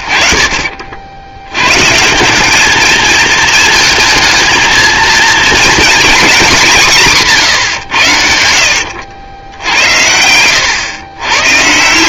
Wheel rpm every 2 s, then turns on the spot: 70, 190, 220, 210, 80, 100.
10-12